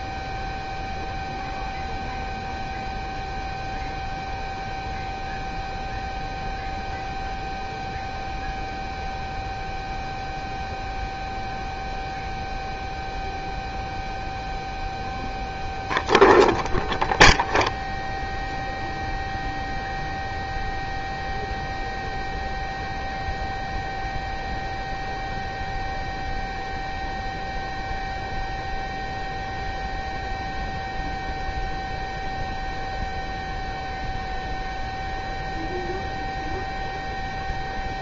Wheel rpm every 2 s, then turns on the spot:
0, 0, 0, 0, 0, 0, 0, 0, 0, 0, 0, 0, 0, 0, 0, 0, 0, 0, 0.
none